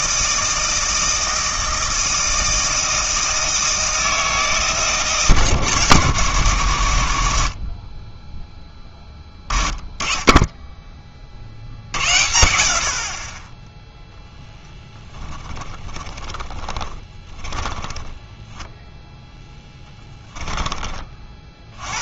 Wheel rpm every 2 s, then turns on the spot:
160, 160, 160, 120, 20, 20, 80, 10, 20, 10, 20.
14-20